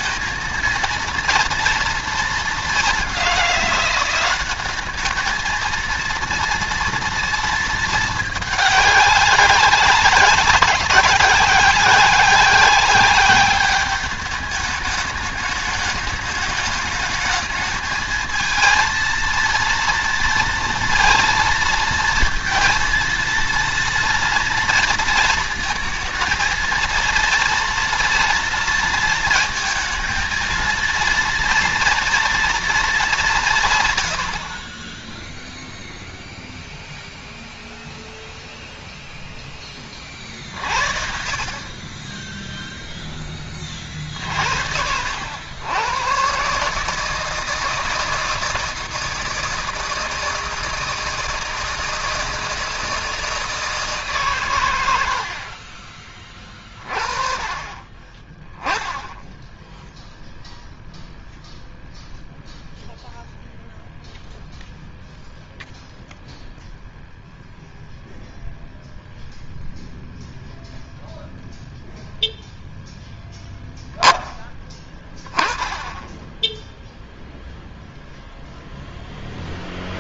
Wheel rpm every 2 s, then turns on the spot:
230, 200, 210, 230, 200, 190, 200, 210, 210, 230, 230, 230, 230, 230, 230, 230, 200, 10, 0, 0, 60, 10, 70, 150, 160, 160, 160, 80, 30, 10, 0, 0, 0, 0, 0, 0, 0, 20, 0, 0.
none